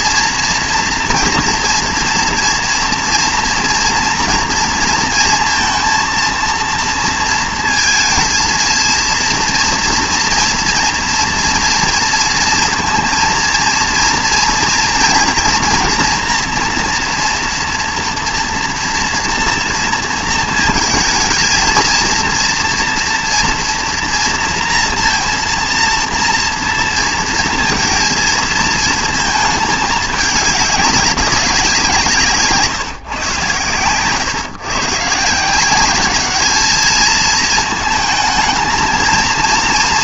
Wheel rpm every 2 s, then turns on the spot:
230, 230, 230, 230, 220, 230, 230, 230, 230, 240, 220, 230, 230, 230, 230, 210, 160, 130, 210, 220.
none